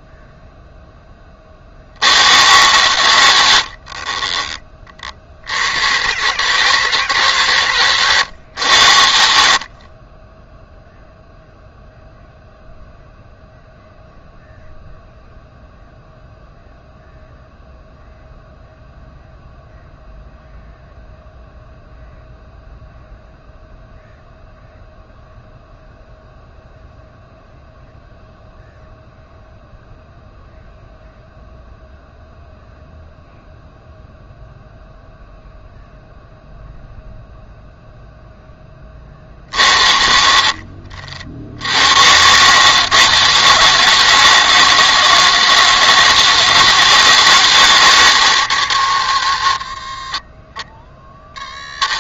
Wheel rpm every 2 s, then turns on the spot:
10, 100, 40, 150, 80, 0, 0, 0, 0, 0, 0, 0, 0, 0, 0, 0, 0, 0, 0, 10, 60, 140, 160, 160, 110, 50.
none